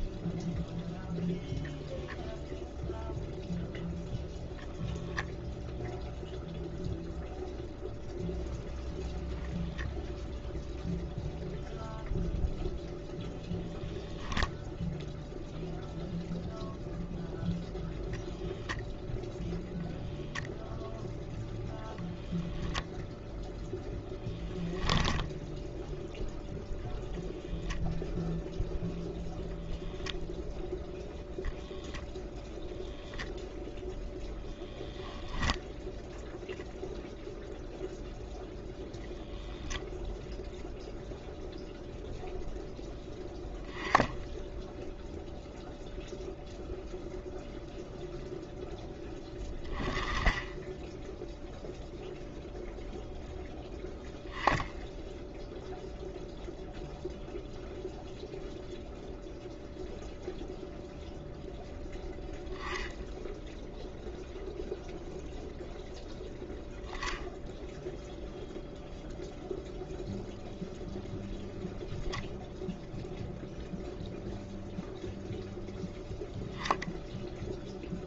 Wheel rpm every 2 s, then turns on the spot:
0, 0, 0, 0, 0, 0, 0, 0, 0, 0, 0, 10, 0, 0, 0, 0, 0, 0, 0, 0, 0, 0, 0, 0, 0, 0, 0, 0, 0, 0, 0, 0, 0, 0, 0, 10, 10, 0, 0.
none